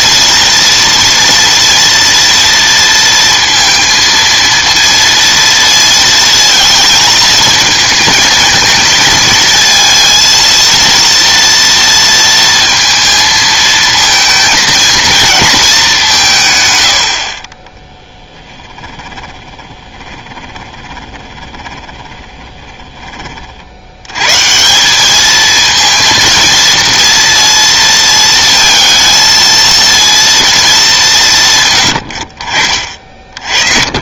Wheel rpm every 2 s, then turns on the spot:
230, 230, 230, 220, 220, 230, 230, 220, 130, 10, 20, 20, 150, 230, 230, 220, 50.
18-24